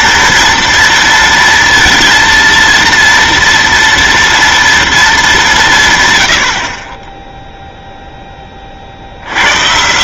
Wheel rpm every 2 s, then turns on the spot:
230, 230, 230, 70, 30.
none